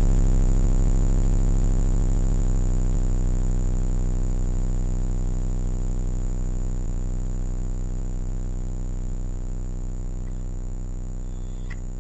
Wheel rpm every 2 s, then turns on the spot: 0, 0, 0, 0, 0, 0.
none